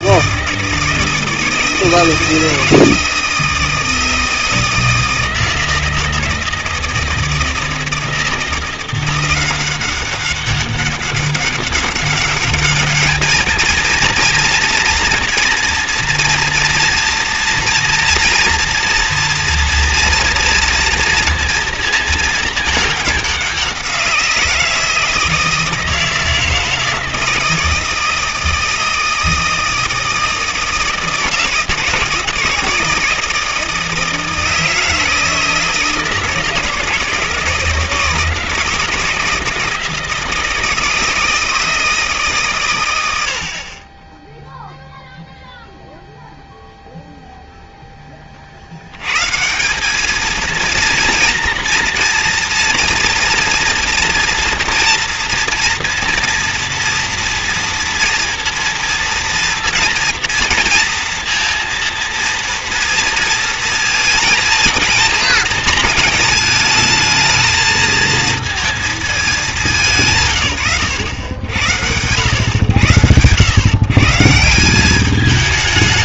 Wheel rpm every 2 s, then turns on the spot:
160, 160, 160, 160, 170, 200, 200, 230, 230, 230, 240, 220, 170, 160, 160, 160, 160, 160, 160, 160, 160, 130, 0, 0, 50, 230, 230, 230, 230, 230, 230, 230, 220, 220, 230, 140, 110, 170.
none